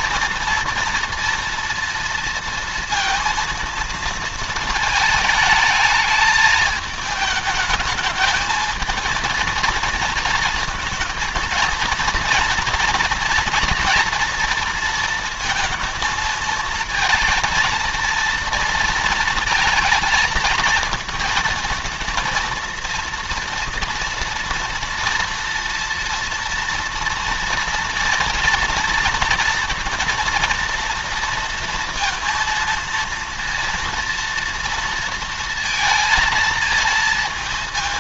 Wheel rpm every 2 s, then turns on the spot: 230, 230, 230, 220, 220, 220, 230, 230, 220, 230, 220, 230, 230, 230, 230, 230, 230, 230, 220.
none